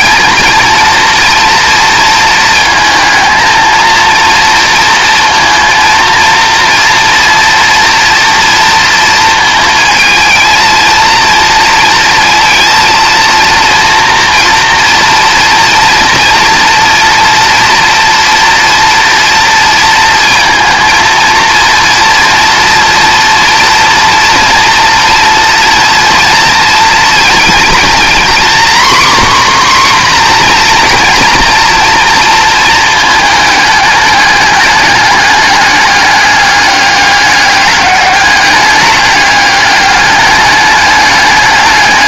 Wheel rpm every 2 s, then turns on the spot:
230, 220, 230, 230, 230, 230, 230, 230, 230, 230, 230, 230, 230, 230, 260, 240, 230, 210, 210, 200, 210.
none